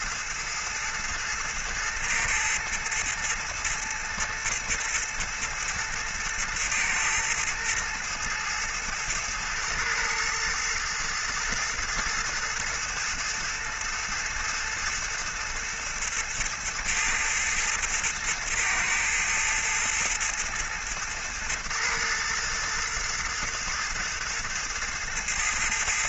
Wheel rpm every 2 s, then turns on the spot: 110, 110, 110, 110, 110, 110, 110, 110, 110, 110, 110, 110, 110.
none